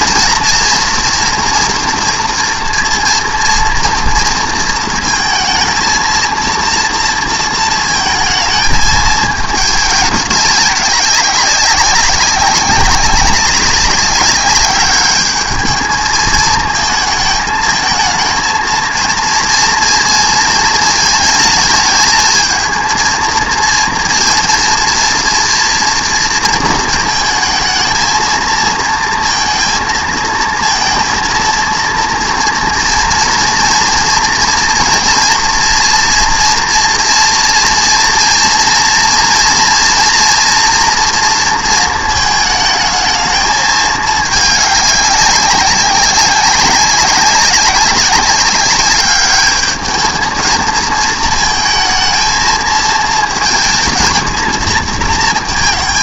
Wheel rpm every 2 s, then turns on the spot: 230, 230, 230, 230, 220, 200, 200, 200, 220, 230, 230, 230, 230, 230, 230, 230, 230, 230, 230, 230, 240, 220, 200, 190, 200, 230, 220, 220.
none